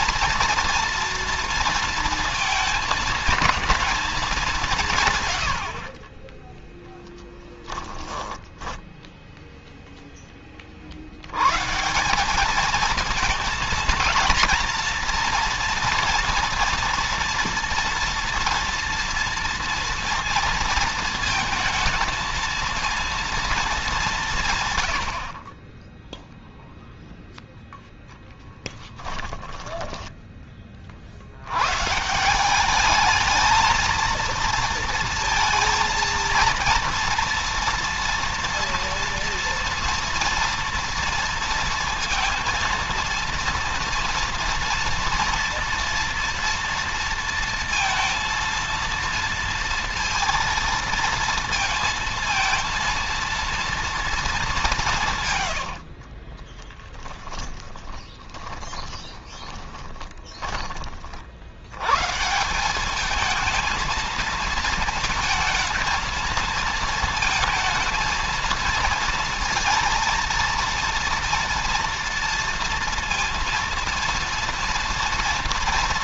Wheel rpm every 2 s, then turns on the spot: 230, 230, 210, 20, 10, 10, 180, 230, 230, 230, 230, 230, 170, 0, 0, 10, 160, 230, 230, 240, 230, 230, 230, 230, 230, 230, 230, 220, 40, 20, 20, 140, 230, 230, 220, 230, 230, 230.
6-10 30-32 56-62